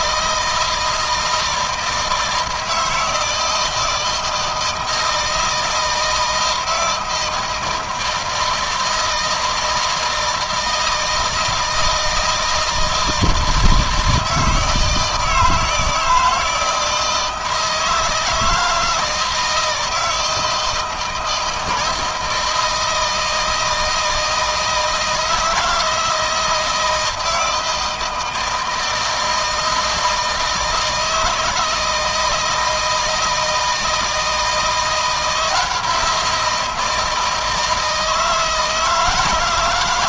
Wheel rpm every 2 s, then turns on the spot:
160, 160, 160, 160, 160, 160, 160, 160, 160, 160, 160, 160, 160, 160, 160, 160, 160, 160, 170, 160.
none